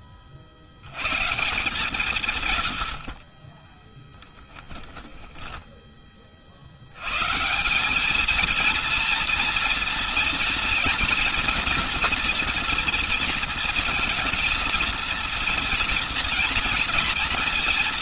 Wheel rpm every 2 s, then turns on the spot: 40, 140, 10, 60, 220, 230, 230, 230, 230.
4-6